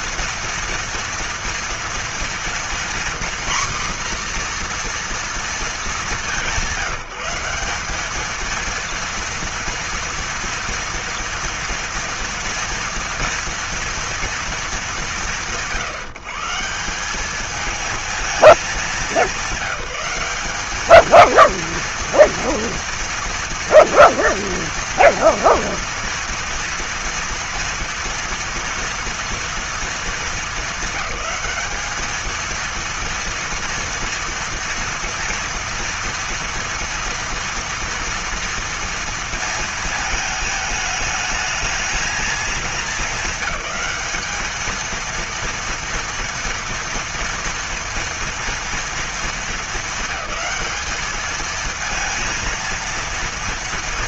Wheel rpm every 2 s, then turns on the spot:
230, 240, 240, 200, 220, 230, 230, 230, 160, 220, 200, 230, 230, 230, 230, 220, 220, 230, 230, 230, 220, 220, 220, 230, 230, 210, 230.
none